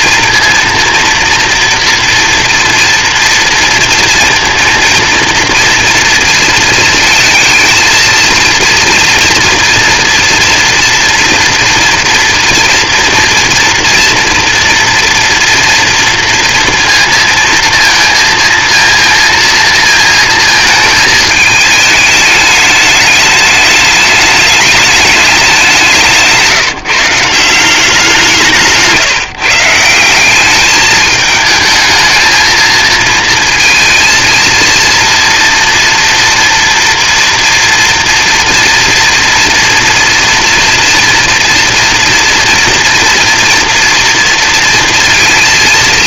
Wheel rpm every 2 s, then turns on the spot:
230, 230, 240, 230, 230, 240, 240, 230, 230, 230, 220, 210, 210, 150, 160, 200, 230, 230, 240, 230, 230, 230, 230.
28-30